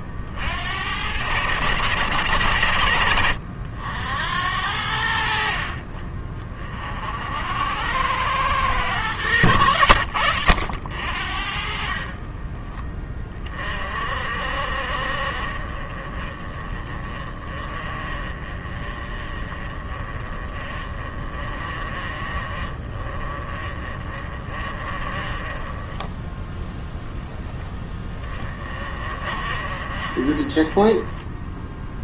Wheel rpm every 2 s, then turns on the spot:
80, 80, 80, 50, 110, 70, 20, 40, 30, 30, 30, 30, 20, 0, 30, 20.
none